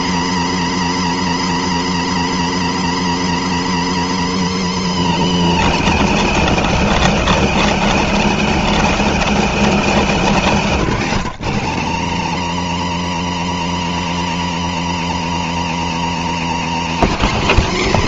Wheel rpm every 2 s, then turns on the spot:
0, 0, 10, 20, 0, 30, 10, 0, 0.
4-8